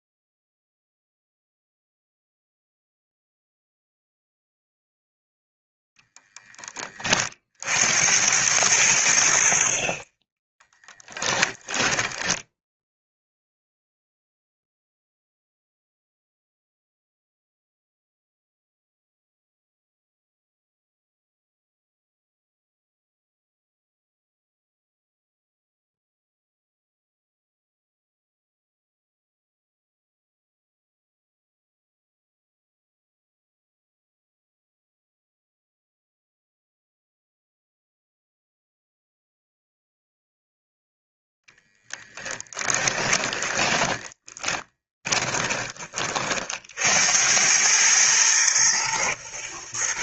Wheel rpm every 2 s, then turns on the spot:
0, 0, 0, 20, 100, 20, 10, 0, 0, 0, 0, 0, 0, 0, 0, 0, 0, 0, 0, 0, 0, 20, 20, 70, 120.
10-12 42-46